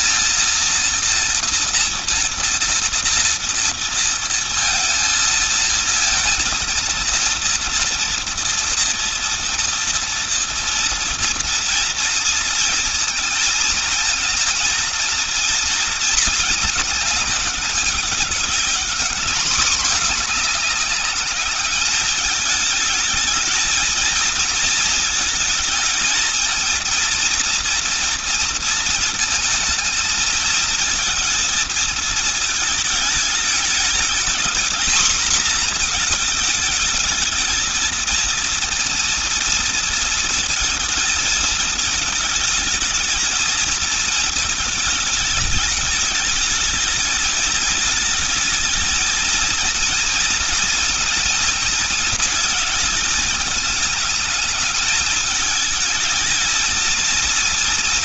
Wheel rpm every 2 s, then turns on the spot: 230, 230, 230, 230, 230, 230, 230, 230, 220, 200, 210, 220, 220, 230, 230, 230, 220, 220, 220, 230, 220, 220, 220, 210, 220, 230, 220, 220, 220.
none